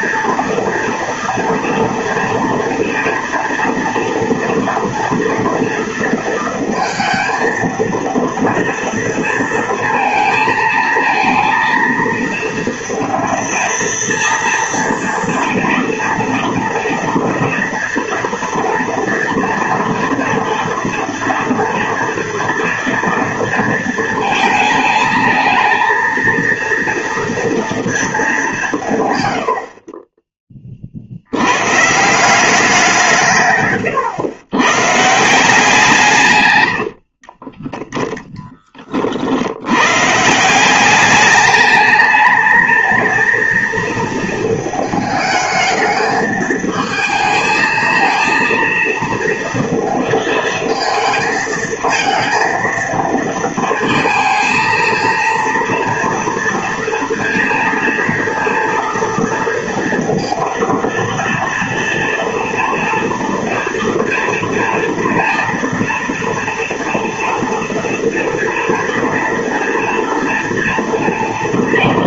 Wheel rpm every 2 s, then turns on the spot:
230, 230, 230, 230, 230, 230, 230, 230, 240, 230, 230, 230, 220, 230, 170, 40, 180, 130, 100, 30, 190, 220, 220, 220, 230, 220, 230, 230, 230, 230, 230, 230, 230, 230, 230, 230.
36-38